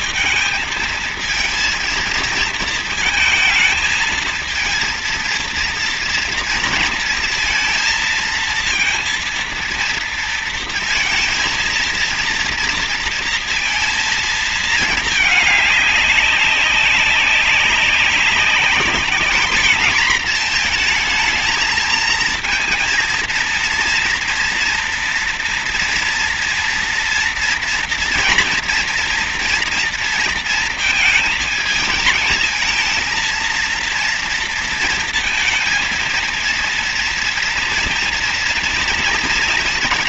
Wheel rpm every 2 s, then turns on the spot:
220, 220, 230, 230, 230, 230, 230, 220, 200, 210, 230, 230, 230, 230, 230, 230, 220, 230, 230, 230.
none